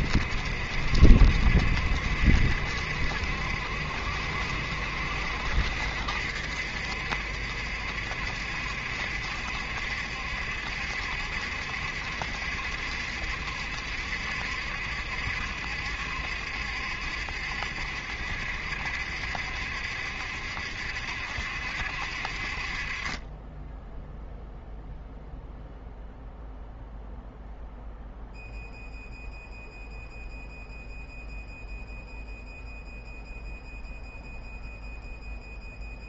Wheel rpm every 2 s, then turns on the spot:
70, 70, 70, 70, 70, 70, 70, 70, 70, 70, 70, 30, 0, 0, 0, 0, 0, 0.
none